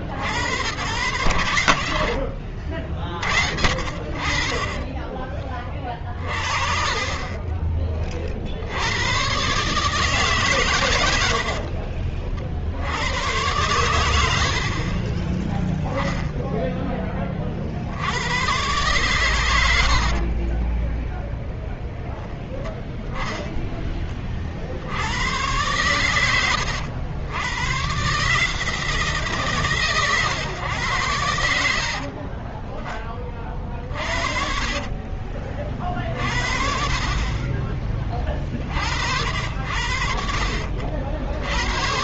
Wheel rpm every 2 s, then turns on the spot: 60, 50, 30, 30, 70, 140, 50, 70, 10, 110, 30, 0, 50, 90, 150, 110, 20, 40, 40, 20, 60.
2-4 20-22 32-36